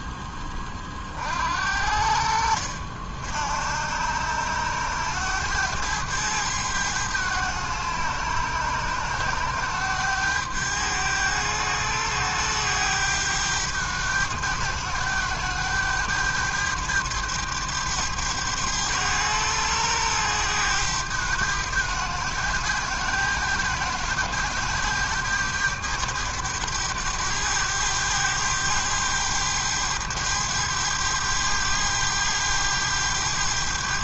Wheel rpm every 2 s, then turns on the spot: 20, 60, 100, 100, 100, 100, 100, 100, 100, 100, 100, 100, 100, 100, 100, 100, 100.
none